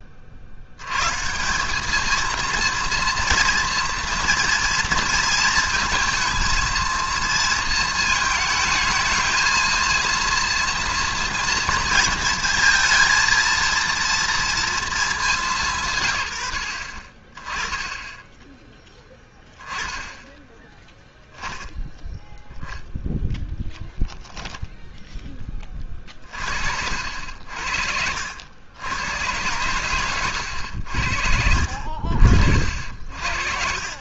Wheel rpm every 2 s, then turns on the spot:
80, 230, 230, 230, 220, 230, 220, 230, 80, 10, 10, 0, 0, 50, 90, 90, 60.
none